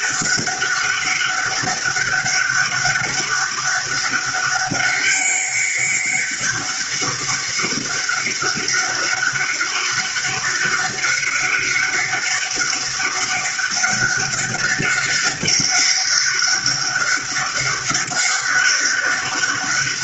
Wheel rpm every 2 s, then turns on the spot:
200, 200, 200, 200, 200, 200, 200, 200, 200, 200.
none